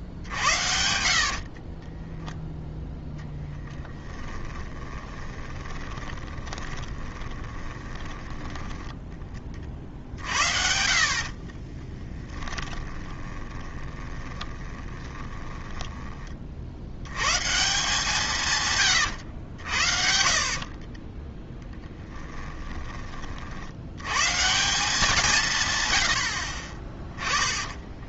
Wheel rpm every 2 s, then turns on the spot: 60, 0, 20, 20, 10, 60, 20, 20, 70, 140, 40, 20, 170, 30.
4-8 12-16 18-22 26-28